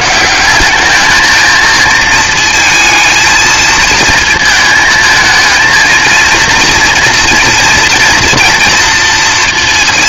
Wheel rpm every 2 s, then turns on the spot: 190, 220, 220, 230, 230.
none